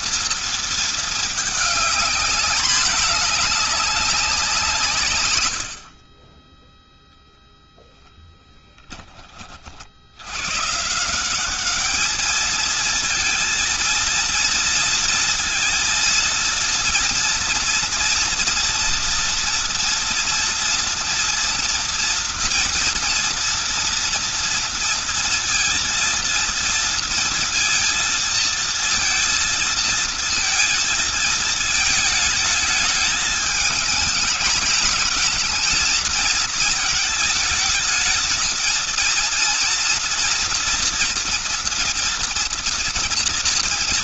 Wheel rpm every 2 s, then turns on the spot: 230, 210, 190, 20, 10, 120, 220, 230, 230, 230, 230, 240, 230, 230, 230, 230, 220, 220, 220, 220, 240, 230.
none